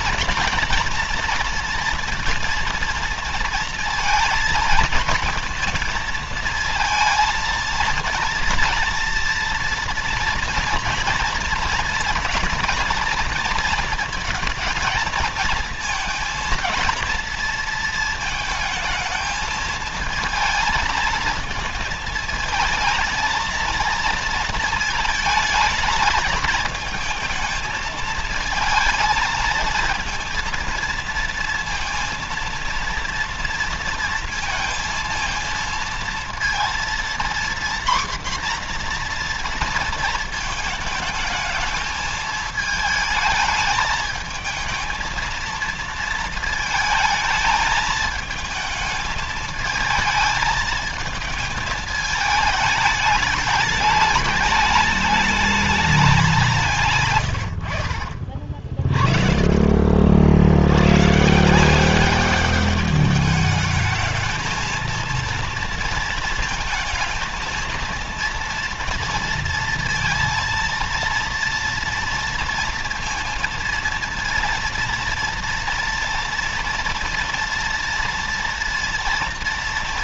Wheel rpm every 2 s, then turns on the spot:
230, 230, 230, 220, 230, 240, 230, 230, 230, 220, 220, 220, 220, 220, 220, 230, 230, 230, 240, 240, 220, 220, 230, 220, 220, 220, 210, 210, 140, 40, 100, 210, 230, 230, 230, 230, 230, 230, 230, 230.
56-58